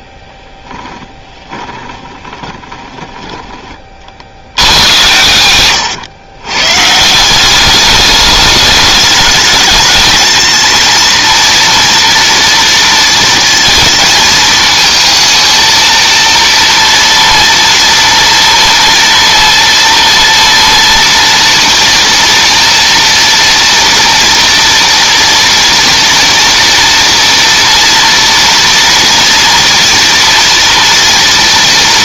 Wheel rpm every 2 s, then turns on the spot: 10, 20, 90, 140, 210, 230, 230, 220, 230, 230, 230, 230, 230, 230, 230, 240.
0-4